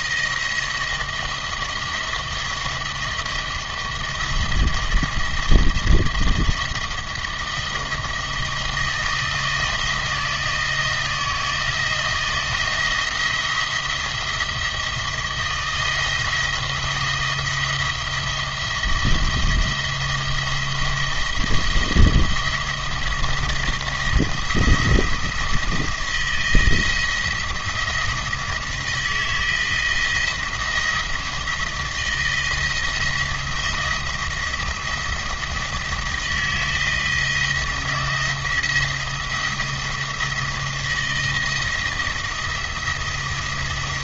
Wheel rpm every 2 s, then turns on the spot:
170, 170, 170, 170, 160, 160, 170, 170, 170, 170, 170, 170, 170, 170, 170, 170, 160, 170, 170, 170, 170, 170.
none